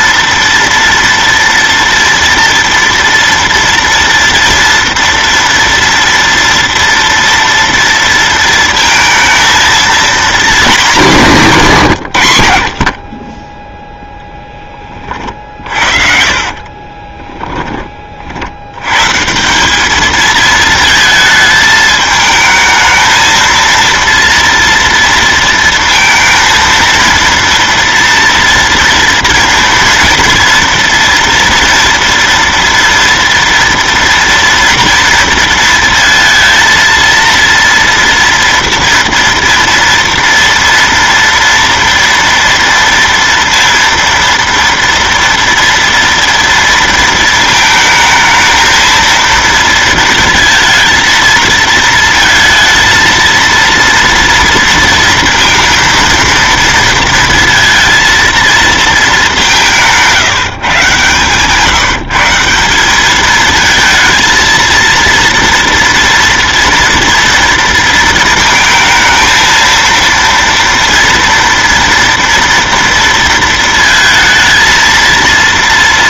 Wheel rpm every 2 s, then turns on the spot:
230, 230, 230, 230, 230, 230, 90, 10, 40, 60, 220, 220, 230, 230, 230, 230, 230, 230, 230, 230, 230, 230, 230, 230, 220, 230, 230, 230, 230, 230, 150, 180, 230, 230, 220, 230, 230, 230.
16-18